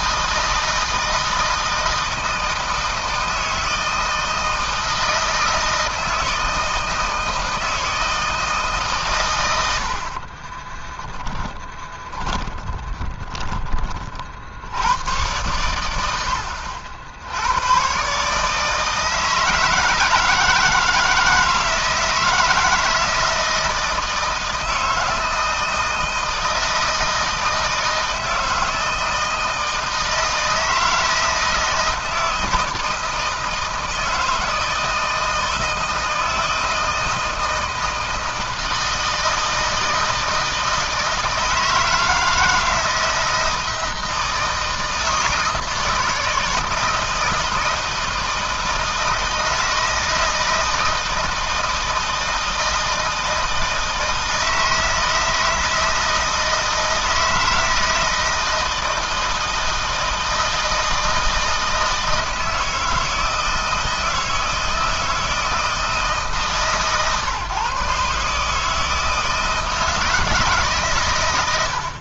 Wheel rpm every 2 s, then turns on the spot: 160, 160, 160, 160, 140, 30, 20, 90, 50, 160, 160, 160, 160, 160, 160, 160, 160, 160, 160, 160, 160, 160, 160, 160, 160, 160, 160, 160, 170, 160, 160, 160, 160, 140, 160, 130.
10-14